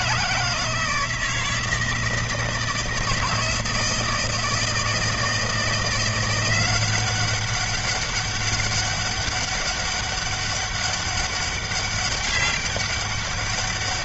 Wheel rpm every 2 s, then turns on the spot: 160, 160, 160, 190, 200, 200, 200.
none